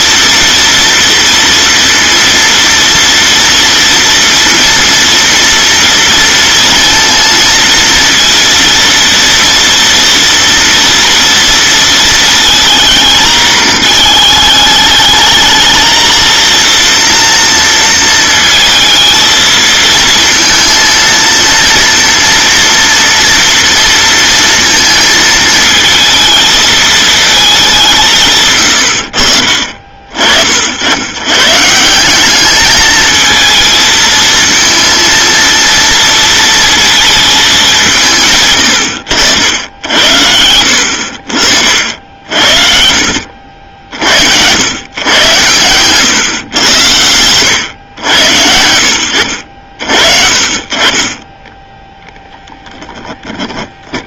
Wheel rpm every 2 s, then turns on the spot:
230, 230, 230, 230, 230, 230, 220, 210, 230, 230, 230, 230, 230, 220, 110, 70, 210, 230, 220, 110, 70, 60, 100, 100, 80, 40, 10.
28-30 40-42 52-54